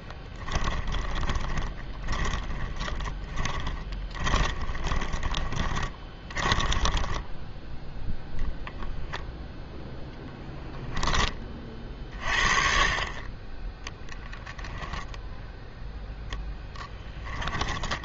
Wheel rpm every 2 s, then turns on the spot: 10, 20, 20, 10, 0, 0, 30, 0, 10.
0-8 16-18